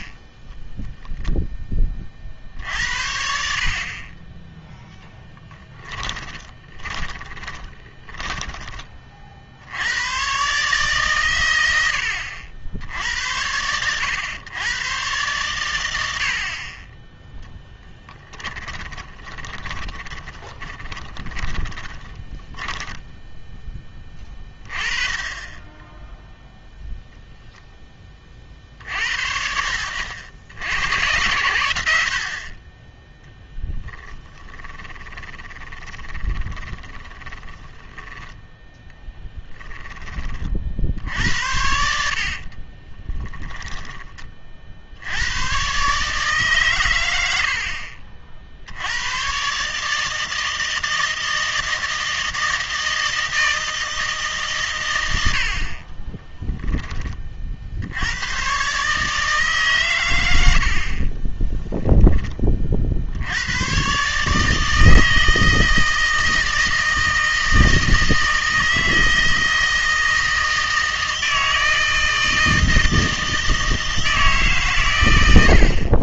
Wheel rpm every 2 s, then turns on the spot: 0, 60, 10, 20, 20, 130, 80, 110, 30, 20, 20, 10, 20, 0, 50, 90, 30, 30, 20, 10, 50, 30, 50, 130, 70, 160, 160, 120, 10, 140, 70, 50, 160, 160, 160, 160, 160, 140.
6-8 18-24 34-40 42-44